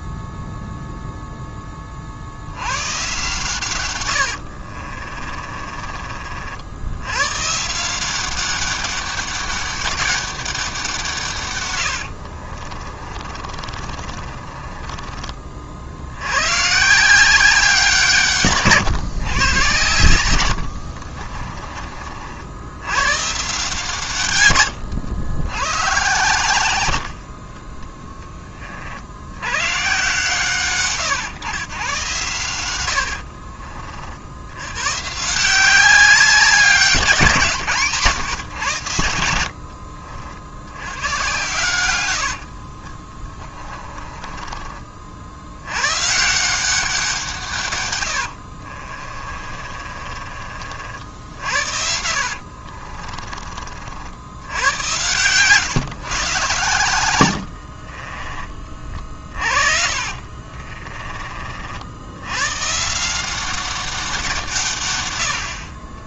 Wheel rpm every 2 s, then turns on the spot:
0, 100, 50, 70, 190, 180, 40, 30, 140, 140, 100, 70, 110, 110, 30, 130, 100, 100, 190, 110, 80, 50, 30, 170, 60, 50, 50, 100, 110, 30, 30, 130, 140.
4-6 12-16 20-22 42-46 48-50 52-54 60-62